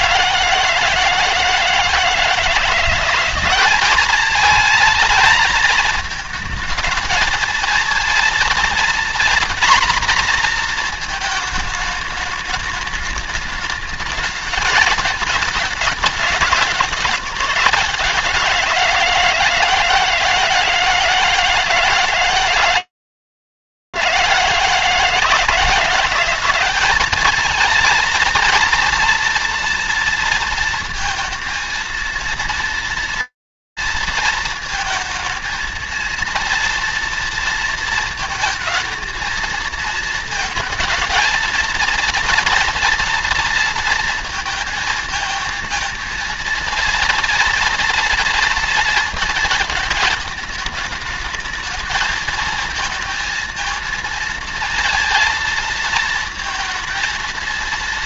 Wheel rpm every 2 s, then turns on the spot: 160, 170, 220, 220, 230, 240, 210, 220, 200, 170, 160, 160, 170, 220, 230, 230, 230, 230, 230, 230, 230, 230, 230, 230, 220, 220, 230, 230, 230.
none